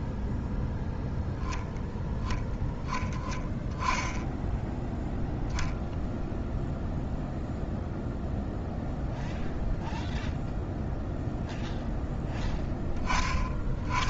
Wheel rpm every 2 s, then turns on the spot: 0, 10, 10, 0, 0, 0, 10.
none